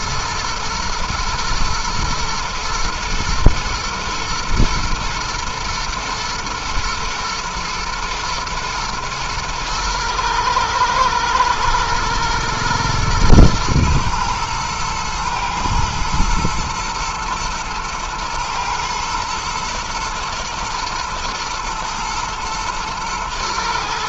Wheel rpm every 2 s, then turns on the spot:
120, 120, 110, 110, 110, 110, 110, 110, 110, 120, 110, 110.
none